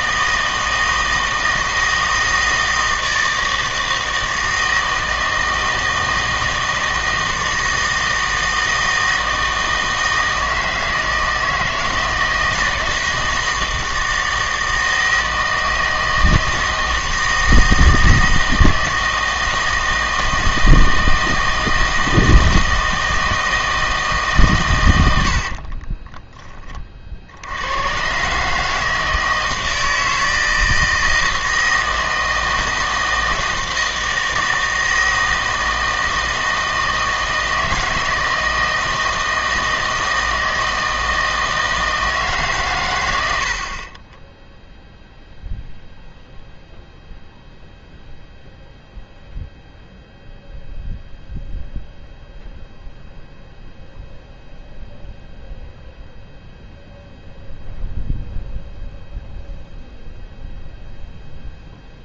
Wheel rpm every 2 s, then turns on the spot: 160, 160, 160, 160, 160, 160, 160, 160, 160, 160, 160, 160, 120, 30, 150, 160, 160, 160, 160, 160, 160, 130, 0, 0, 0, 0, 0, 0, 0, 0, 0.
none